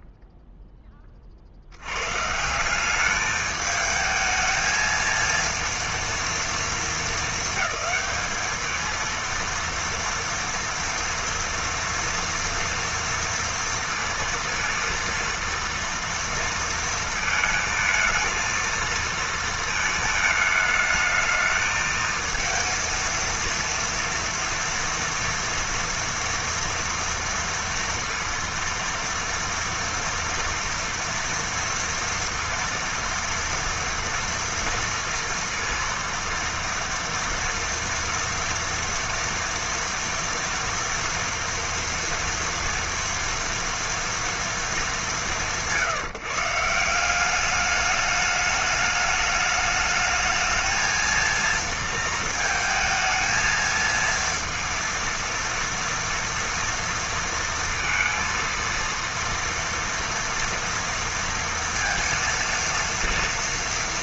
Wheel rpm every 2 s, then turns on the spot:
0, 160, 220, 230, 220, 230, 230, 230, 230, 220, 220, 230, 230, 230, 230, 240, 230, 240, 230, 230, 230, 230, 220, 150, 210, 220, 220, 230, 230, 230, 230, 230.
none